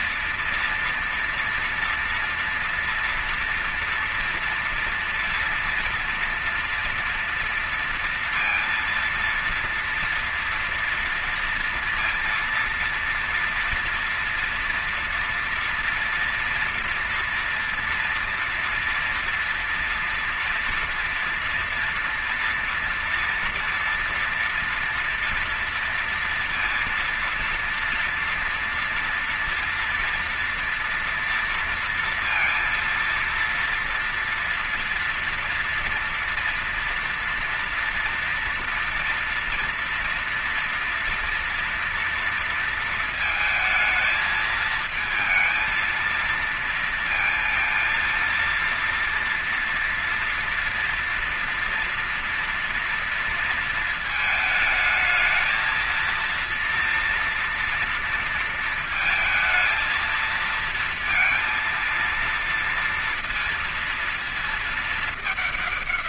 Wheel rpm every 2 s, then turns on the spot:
230, 230, 230, 230, 230, 230, 230, 230, 230, 230, 230, 240, 230, 230, 230, 230, 230, 230, 230, 230, 230, 230, 220, 230, 230, 230, 230, 220, 230, 230, 220, 230, 230.
none